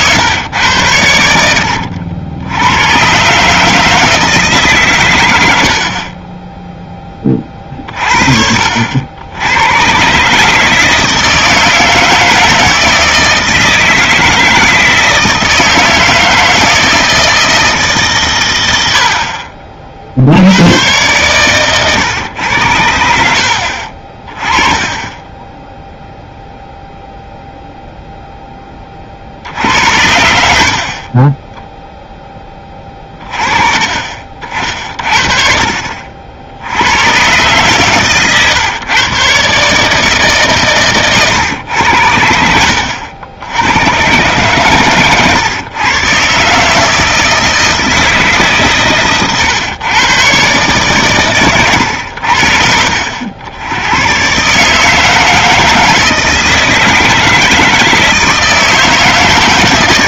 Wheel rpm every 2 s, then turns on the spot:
100, 100, 140, 0, 70, 160, 160, 160, 160, 70, 110, 90, 20, 0, 20, 40, 20, 40, 90, 130, 130, 80, 130, 160, 140, 130, 60, 150, 160, 160.
none